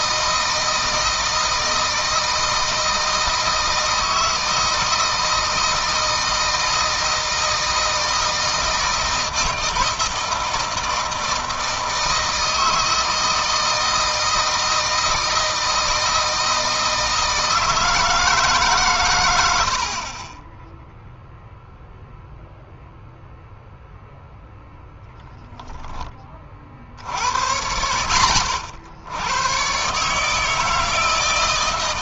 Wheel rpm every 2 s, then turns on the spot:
160, 160, 160, 160, 160, 160, 160, 160, 160, 140, 20, 0, 0, 50, 80, 160.
none